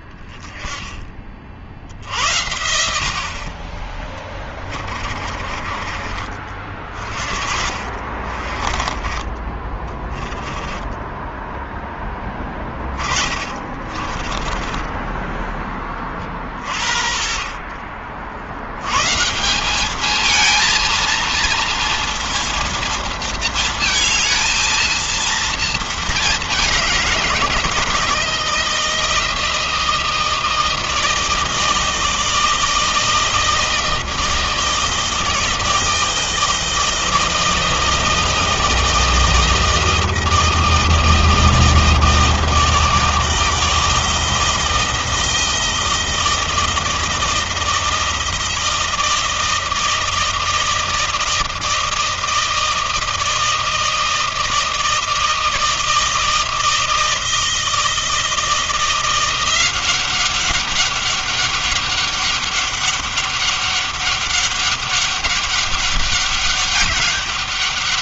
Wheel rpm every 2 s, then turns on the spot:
20, 60, 30, 50, 30, 10, 20, 10, 30, 140, 230, 230, 230, 180, 160, 160, 160, 160, 160, 160, 160, 160, 160, 160, 160, 160, 160, 160, 160, 170, 200, 200, 200, 200.
4-8 10-14